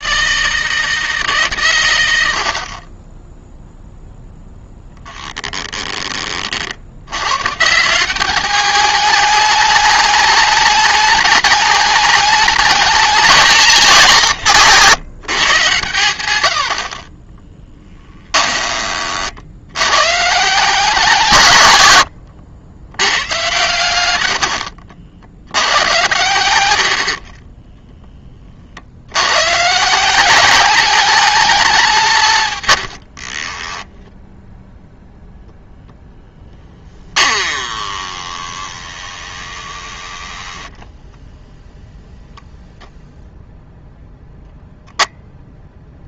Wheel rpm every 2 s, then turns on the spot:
160, 60, 0, 60, 210, 210, 210, 160, 60, 30, 170, 90, 80, 80, 50, 210, 110, 0, 10, 20, 10, 0, 0.
24-28 36-42